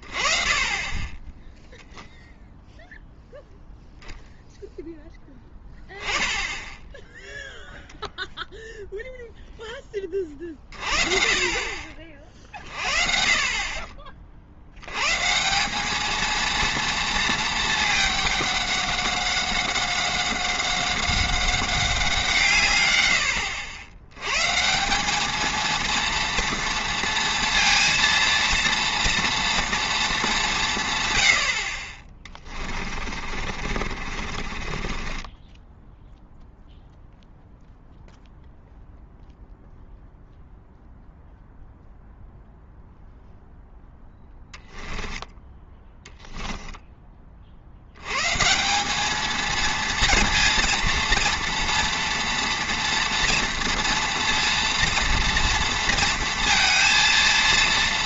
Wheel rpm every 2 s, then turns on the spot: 20, 0, 0, 0, 0, 40, 40, 80, 230, 200, 190, 120, 160, 230, 230, 150, 30, 40, 0, 0, 0, 0, 10, 10, 180, 230, 240, 240, 230.
32-36 44-46